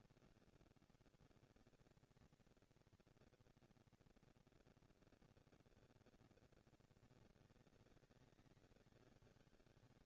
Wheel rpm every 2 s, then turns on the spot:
130, 240, 230, 210, 170.
none